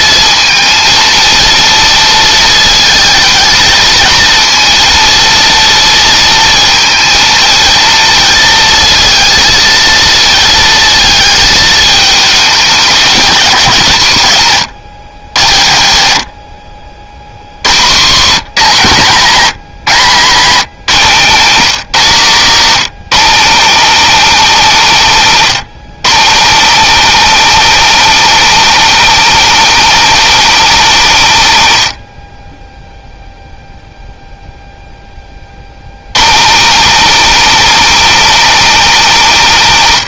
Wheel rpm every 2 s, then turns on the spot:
230, 220, 230, 230, 230, 220, 200, 80, 50, 150, 190, 220, 220, 250, 270, 240, 10, 10, 240, 260.
none